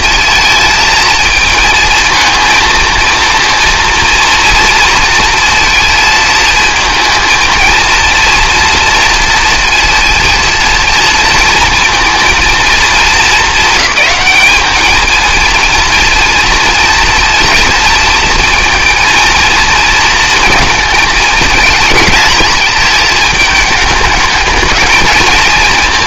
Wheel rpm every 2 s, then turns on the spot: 230, 230, 230, 230, 230, 230, 230, 220, 230, 230, 230, 220, 220.
none